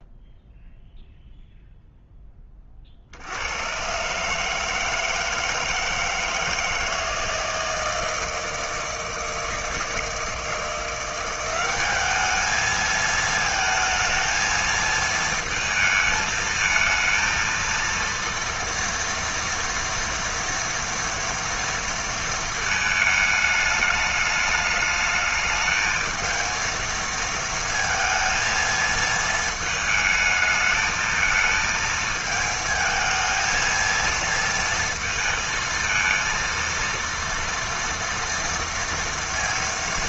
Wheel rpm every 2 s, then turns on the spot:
0, 30, 160, 160, 160, 170, 220, 230, 220, 240, 230, 220, 210, 220, 230, 220, 220, 230, 230, 230.
none